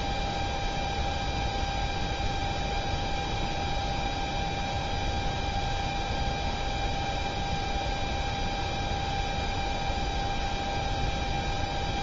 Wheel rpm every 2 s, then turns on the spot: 0, 0, 0, 0, 0, 0.
none